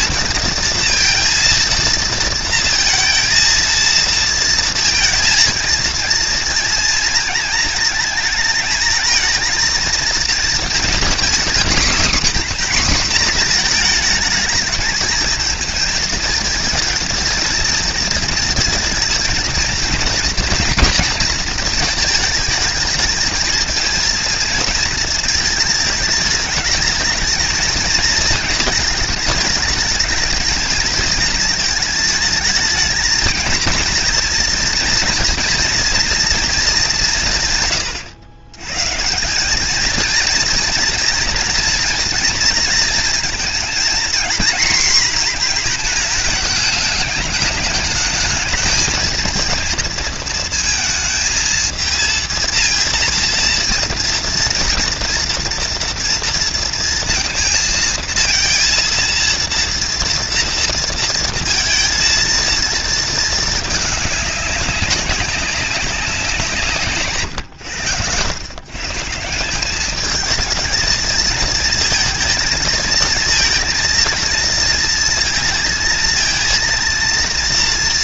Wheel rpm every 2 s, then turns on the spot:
230, 230, 230, 230, 220, 250, 250, 220, 230, 230, 230, 220, 220, 220, 210, 220, 230, 240, 180, 160, 230, 230, 240, 210, 220, 230, 230, 230, 230, 230, 230, 220, 190, 140, 160, 220, 220, 230, 230.
none